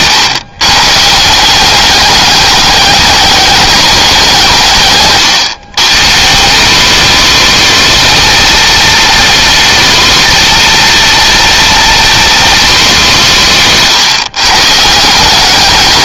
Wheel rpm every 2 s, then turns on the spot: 150, 210, 140, 220, 230, 230, 210, 160.
none